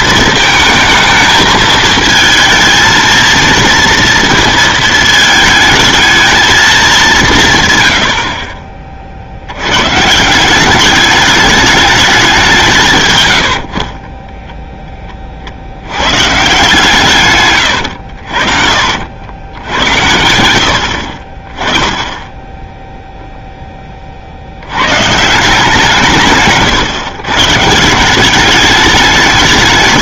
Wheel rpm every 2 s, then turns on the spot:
230, 230, 230, 210, 30, 190, 180, 10, 140, 70, 70, 10, 80, 140, 200.
none